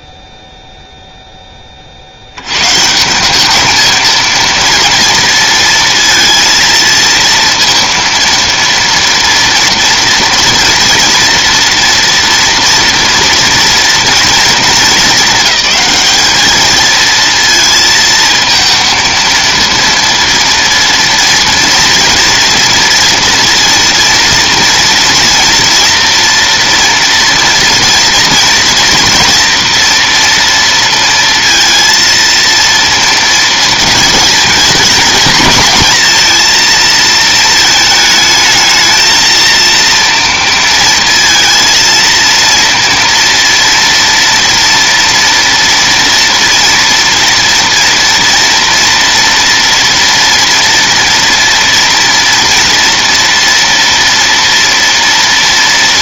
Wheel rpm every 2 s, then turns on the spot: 0, 140, 230, 230, 230, 230, 230, 220, 220, 230, 230, 230, 230, 240, 230, 230, 230, 220, 230, 220, 230, 230, 240, 230, 230, 230, 230, 230.
none